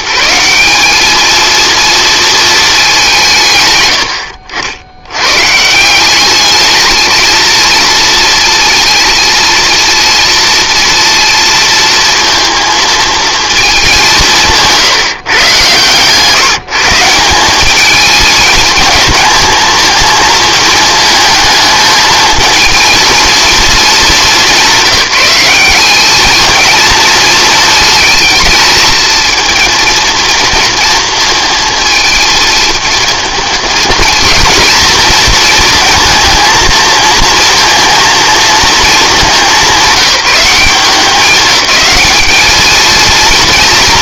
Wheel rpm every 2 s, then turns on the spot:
200, 210, 80, 210, 230, 230, 230, 160, 160, 220, 220, 220, 190, 230, 220, 230, 230, 230, 220, 220, 180, 220.
none